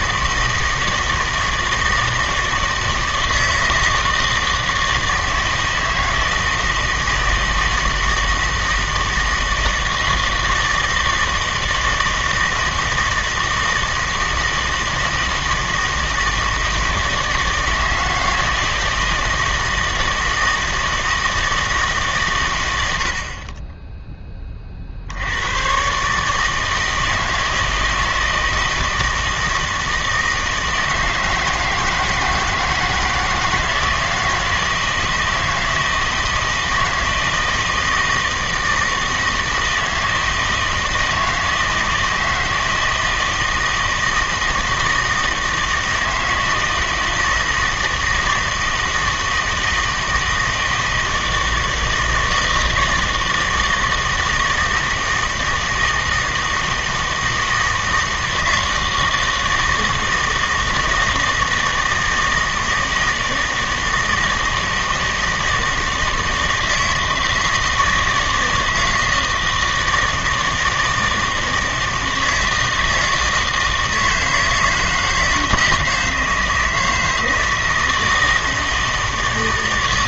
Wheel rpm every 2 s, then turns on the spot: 160, 160, 160, 160, 160, 160, 160, 160, 160, 160, 160, 100, 30, 160, 160, 160, 160, 160, 160, 160, 160, 160, 160, 160, 160, 160, 160, 160, 160, 160, 160, 160, 160, 160, 160, 160, 160, 160, 160, 160.
none